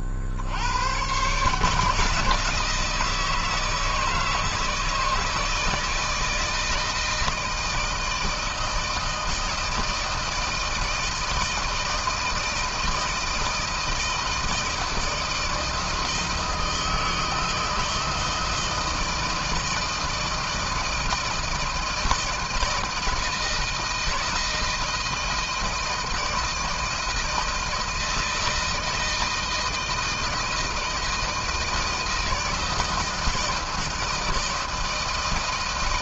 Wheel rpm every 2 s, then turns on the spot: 70, 150, 160, 160, 160, 160, 160, 160, 160, 160, 160, 170, 170, 160, 160, 160, 160, 160.
none